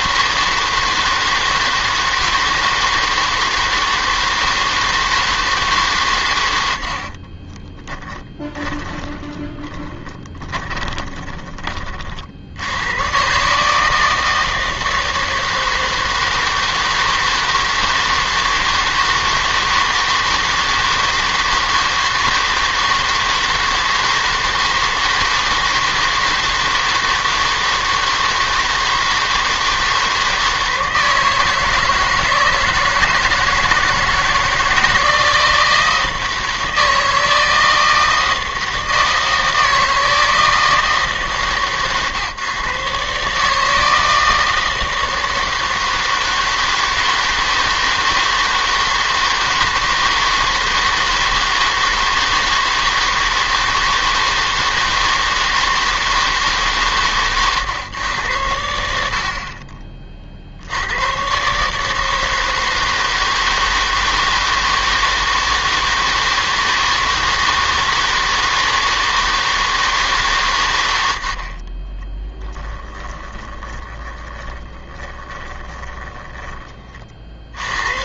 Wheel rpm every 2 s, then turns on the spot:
160, 160, 160, 80, 30, 20, 90, 160, 160, 160, 160, 160, 160, 160, 160, 160, 160, 160, 160, 160, 160, 130, 160, 160, 160, 160, 160, 160, 140, 80, 70, 160, 160, 160, 160, 110, 10, 20, 20.
8-12 72-76